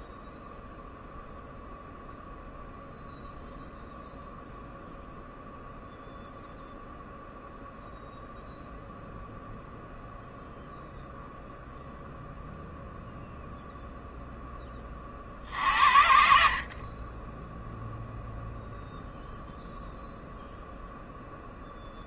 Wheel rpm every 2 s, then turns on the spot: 0, 0, 0, 0, 0, 0, 0, 10, 50, 0, 0.
none